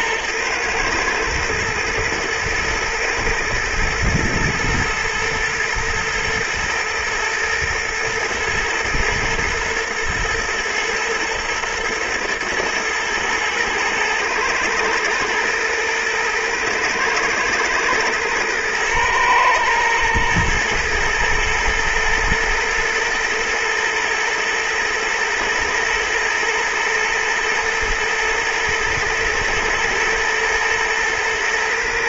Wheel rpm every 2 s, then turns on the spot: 120, 110, 120, 110, 120, 120, 110, 120, 120, 120, 110, 110, 110, 110, 120, 120.
none